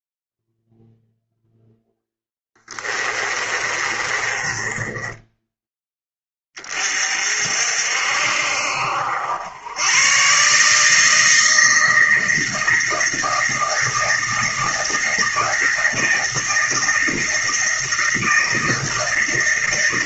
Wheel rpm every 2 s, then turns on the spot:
0, 10, 20, 20, 60, 140, 160, 160, 160, 160.
2-6